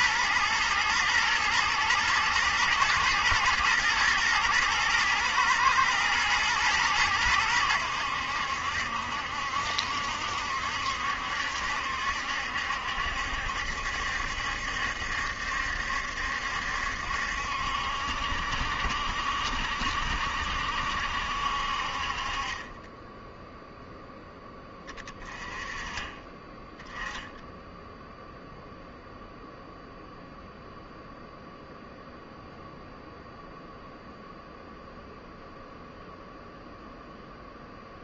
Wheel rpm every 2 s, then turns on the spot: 120, 110, 110, 110, 70, 70, 70, 70, 70, 60, 70, 20, 20, 10, 0, 0, 0, 0, 0.
none